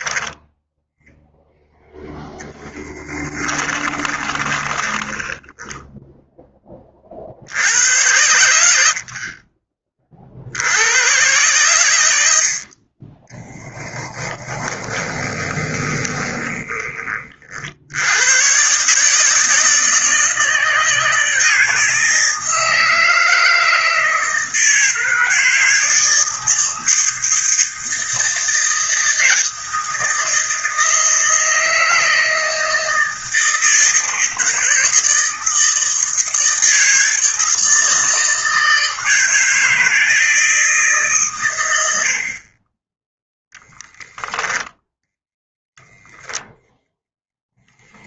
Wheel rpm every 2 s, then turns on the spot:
0, 10, 10, 30, 70, 100, 40, 20, 20, 130, 160, 160, 160, 160, 160, 160, 160, 160, 160, 160, 150, 20, 10, 0.
2-6 14-16 44-46